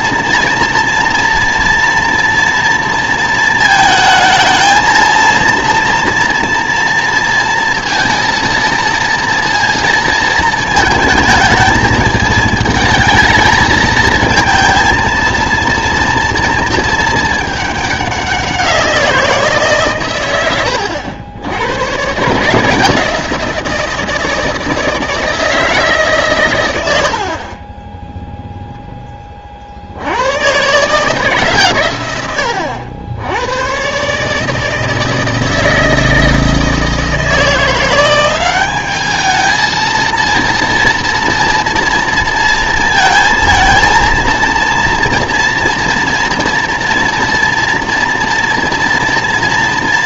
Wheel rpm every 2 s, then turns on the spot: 230, 230, 220, 230, 230, 220, 220, 230, 230, 180, 100, 160, 160, 100, 0, 130, 80, 160, 160, 200, 230, 230, 230, 240, 240.
none